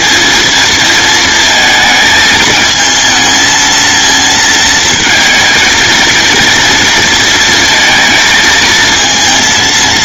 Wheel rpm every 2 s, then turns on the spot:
220, 220, 220, 230, 220.
none